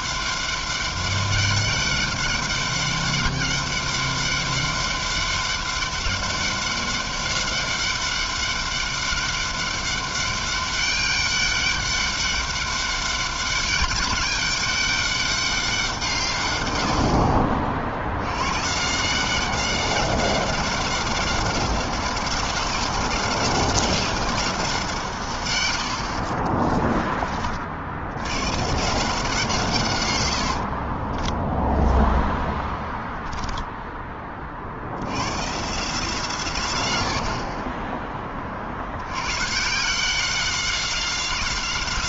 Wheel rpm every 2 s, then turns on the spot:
200, 200, 200, 200, 200, 200, 200, 200, 60, 180, 190, 190, 130, 30, 160, 10, 10, 120, 60, 120, 190.
30-34